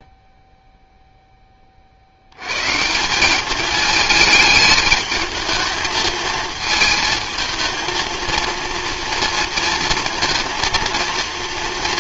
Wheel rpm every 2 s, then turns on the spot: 0, 130, 220, 220, 230, 230.
none